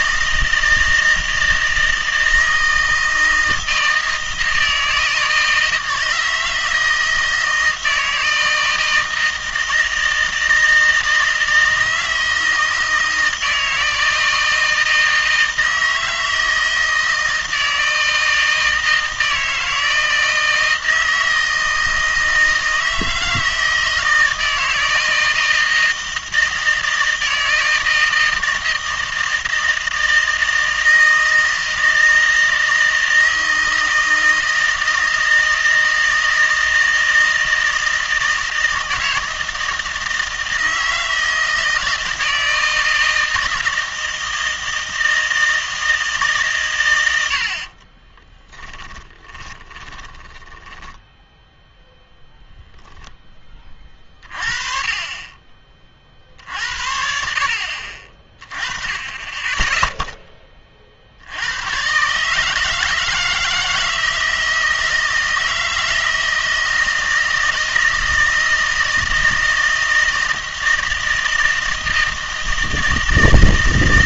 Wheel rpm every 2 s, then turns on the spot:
160, 160, 160, 160, 160, 160, 160, 160, 160, 160, 160, 160, 160, 160, 160, 160, 160, 160, 160, 160, 160, 160, 160, 120, 10, 10, 0, 30, 70, 20, 40, 150, 160, 160, 160, 160, 160.
48-52